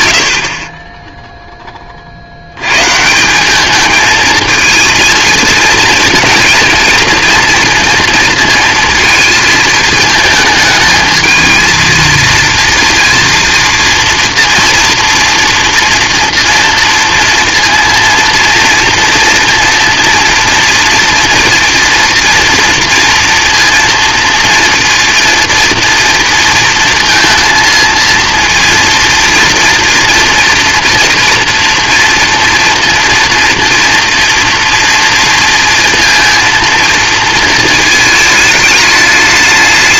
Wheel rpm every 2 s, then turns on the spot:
30, 130, 230, 230, 230, 220, 230, 230, 240, 230, 230, 230, 230, 230, 230, 240, 230, 230, 230, 210.
none